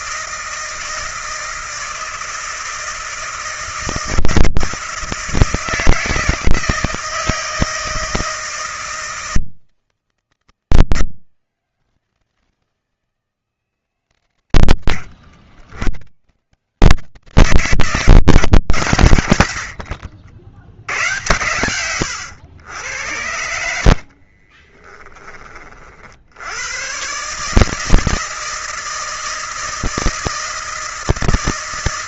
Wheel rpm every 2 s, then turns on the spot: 160, 160, 160, 160, 160, 160, 160, 100, 140, 130, 70, 90, 30, 100, 160, 160.
24-26